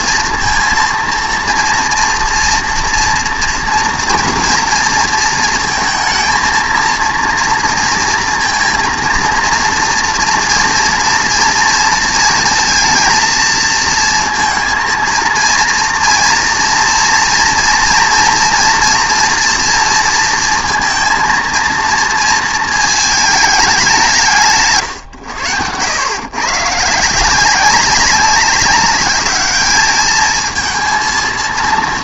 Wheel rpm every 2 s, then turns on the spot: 230, 230, 230, 220, 230, 230, 230, 230, 230, 230, 230, 230, 150, 130, 200, 220.
none